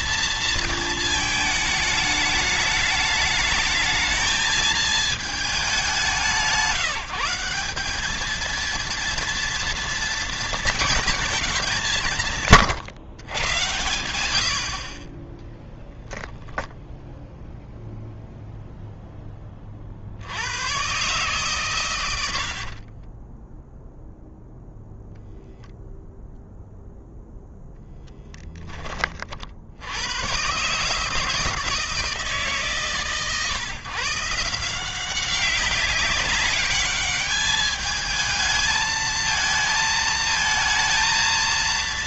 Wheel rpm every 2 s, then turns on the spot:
220, 210, 220, 170, 230, 210, 140, 50, 10, 0, 120, 40, 0, 0, 20, 140, 130, 180, 210, 220, 230.
22-24